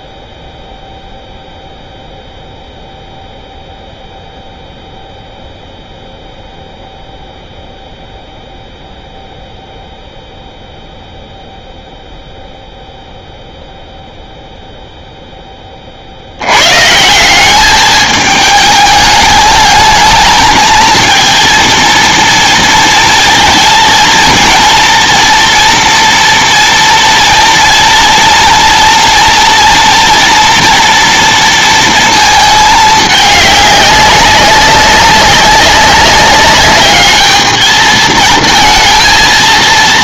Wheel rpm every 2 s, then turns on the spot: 0, 0, 0, 0, 0, 0, 0, 0, 120, 210, 220, 230, 230, 240, 240, 240, 220, 190, 200, 230.
none